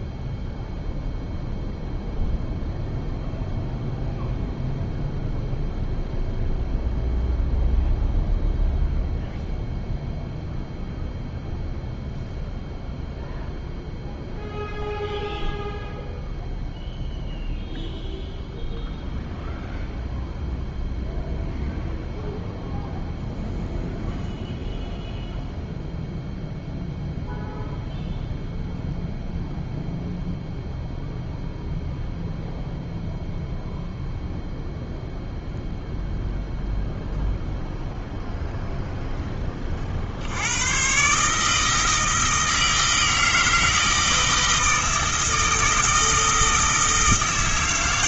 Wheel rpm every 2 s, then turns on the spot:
0, 0, 0, 0, 0, 0, 0, 0, 0, 0, 0, 0, 0, 0, 0, 0, 0, 0, 0, 0, 120, 160, 160, 160.
none